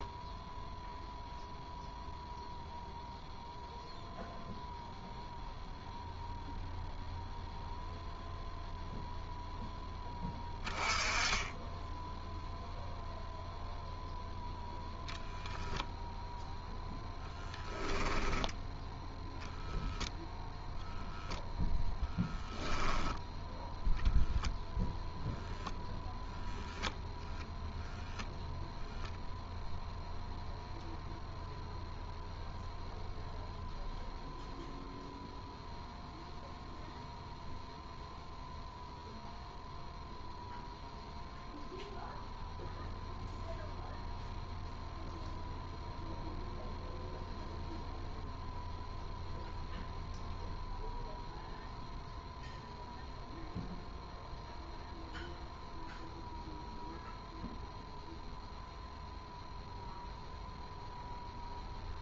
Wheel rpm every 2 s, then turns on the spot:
0, 0, 0, 0, 0, 10, 0, 0, 0, 10, 0, 10, 0, 0, 0, 0, 0, 0, 0, 0, 0, 0, 0, 0, 0, 0, 0, 0, 0, 0, 0.
none